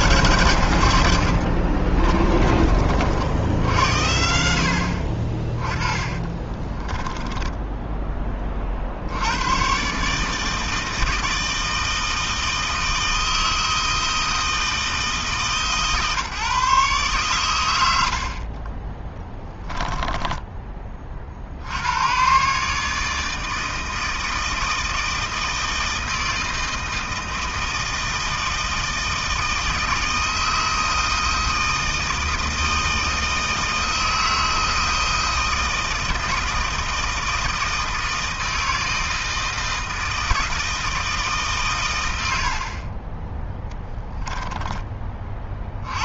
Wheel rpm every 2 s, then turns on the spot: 60, 80, 30, 10, 110, 160, 160, 150, 120, 10, 70, 160, 160, 160, 160, 160, 160, 160, 160, 160, 140, 20, 50.
0-2 4-8 18-20 42-44